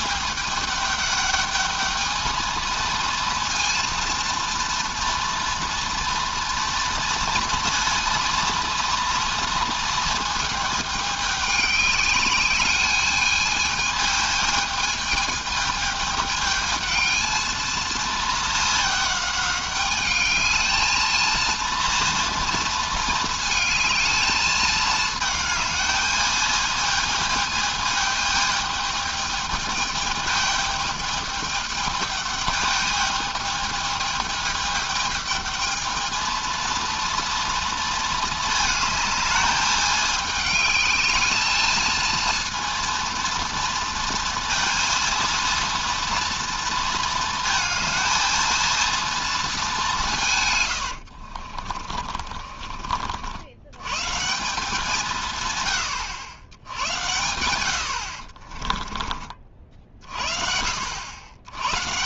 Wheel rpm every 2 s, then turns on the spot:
200, 220, 230, 240, 230, 220, 210, 220, 210, 210, 210, 230, 220, 220, 210, 210, 210, 210, 230, 220, 210, 230, 230, 230, 230, 120, 50, 180, 90, 30, 60.
50-54 58-60